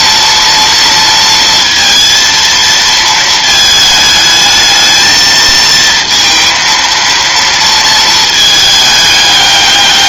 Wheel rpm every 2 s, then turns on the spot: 230, 230, 220, 230, 210.
none